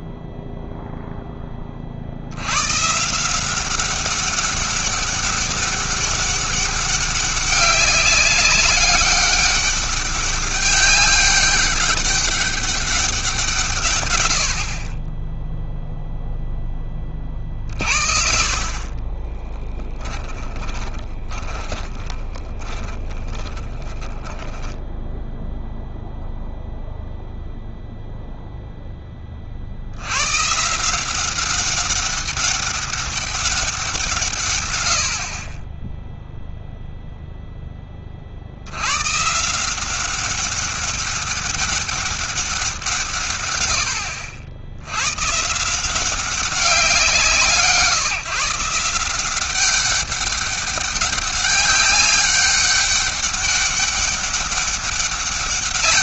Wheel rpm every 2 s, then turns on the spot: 0, 120, 200, 200, 200, 200, 200, 50, 20, 40, 20, 20, 10, 0, 10, 160, 200, 110, 0, 90, 200, 170, 90, 190, 170, 200, 200, 200.
18-26